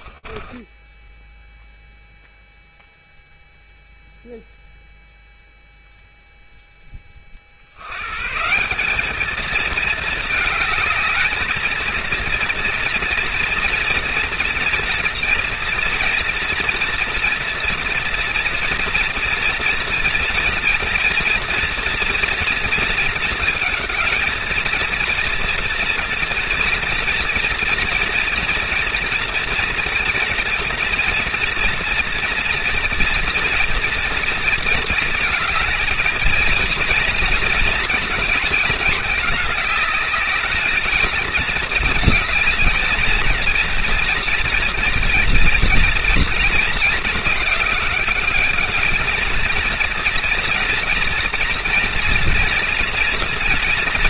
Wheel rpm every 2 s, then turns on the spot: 0, 0, 0, 130, 220, 230, 230, 230, 230, 230, 230, 230, 240, 230, 230, 230, 230, 230, 220, 220, 220, 230, 230, 210, 240, 240, 210.
none